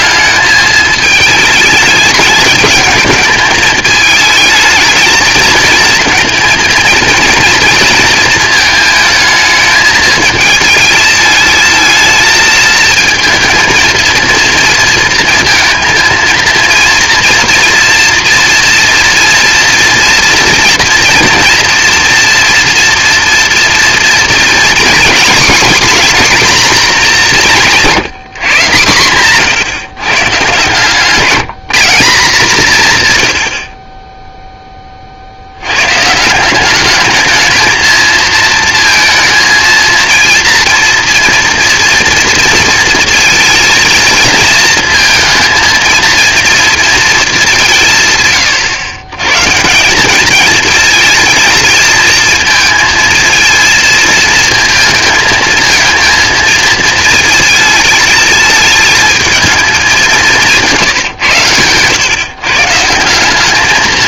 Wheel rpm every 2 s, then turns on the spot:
210, 220, 220, 230, 230, 220, 220, 230, 230, 230, 230, 230, 230, 240, 150, 140, 170, 10, 180, 220, 230, 230, 230, 230, 120, 220, 230, 220, 230, 220, 170, 150.
none